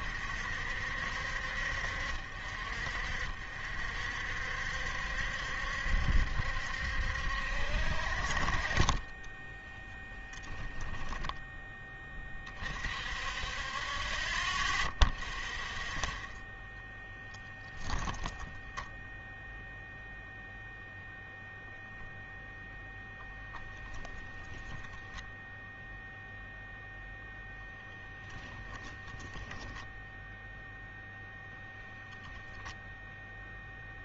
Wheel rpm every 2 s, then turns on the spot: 60, 60, 70, 50, 10, 10, 30, 10, 0, 0, 0, 0, 10, 0, 10, 0, 0.
8-10 28-30